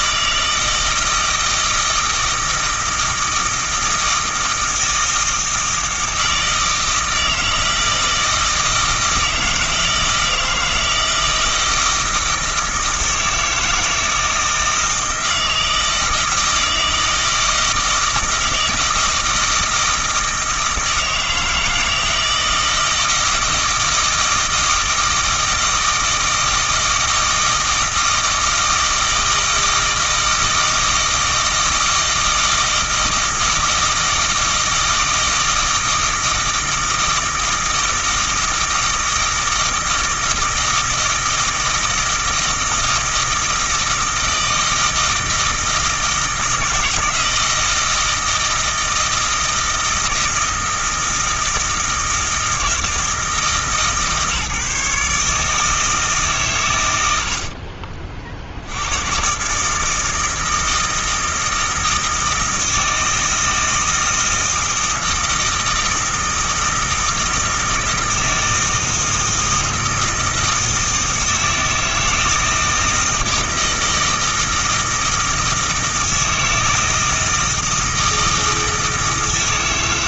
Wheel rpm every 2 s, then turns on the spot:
160, 160, 160, 160, 160, 160, 160, 160, 160, 160, 160, 160, 160, 160, 160, 160, 160, 160, 160, 160, 160, 160, 160, 160, 160, 160, 160, 150, 110, 80, 160, 160, 160, 160, 160, 160, 160, 160, 160, 160.
none